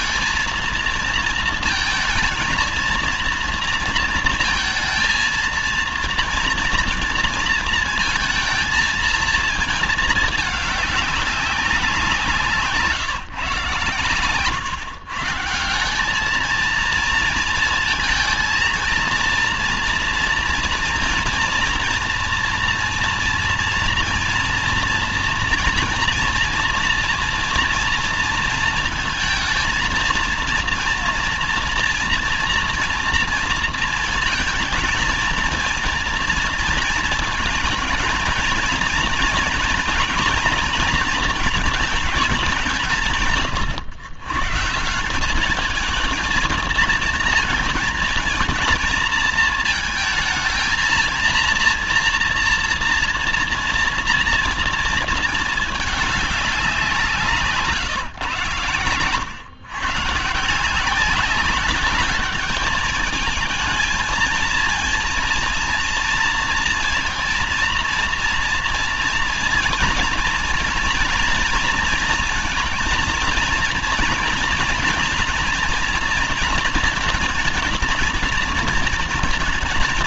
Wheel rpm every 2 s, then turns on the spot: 230, 220, 230, 230, 220, 210, 160, 130, 220, 230, 230, 230, 230, 230, 220, 230, 240, 230, 220, 230, 230, 180, 160, 230, 230, 230, 230, 230, 190, 130, 170, 210, 230, 230, 230, 240, 220, 230, 230, 230.
none